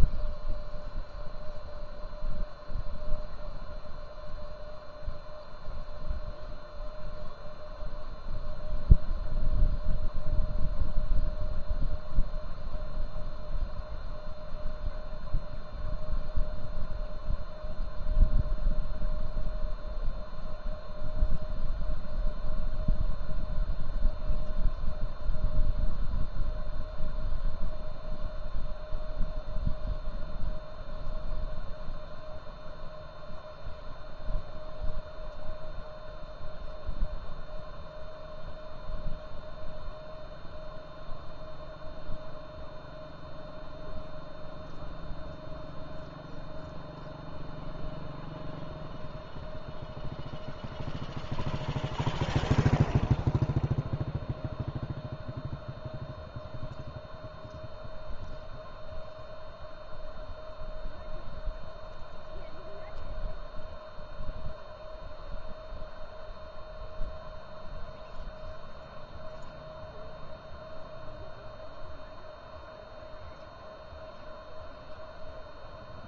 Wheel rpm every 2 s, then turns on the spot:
0, 0, 0, 0, 0, 0, 0, 0, 0, 0, 0, 0, 0, 0, 0, 0, 0, 0, 0, 0, 0, 0, 0, 0, 0, 0, 0, 0, 0, 0, 0, 0, 0, 0, 0, 0, 0, 0.
none